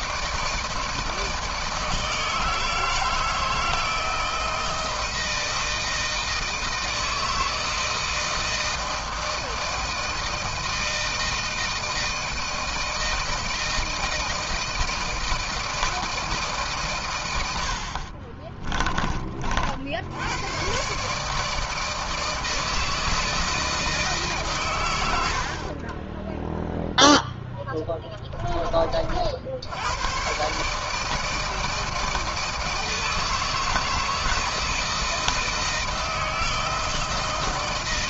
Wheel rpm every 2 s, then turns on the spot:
160, 160, 160, 160, 160, 160, 160, 160, 130, 50, 130, 160, 110, 0, 30, 150, 160, 160, 160.
none